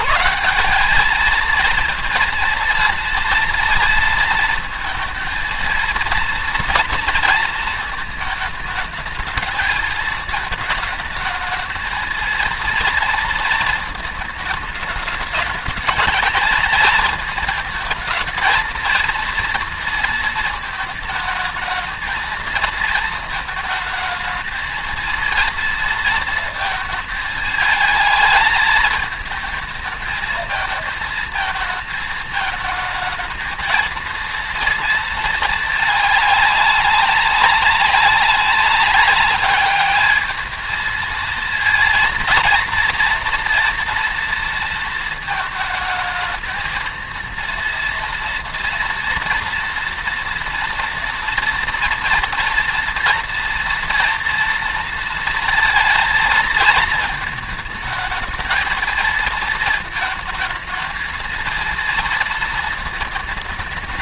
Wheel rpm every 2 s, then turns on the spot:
190, 230, 230, 230, 220, 220, 230, 220, 220, 220, 220, 230, 220, 220, 220, 220, 220, 230, 200, 200, 220, 230, 230, 220, 230, 230, 230, 230, 220, 220, 220, 230.
none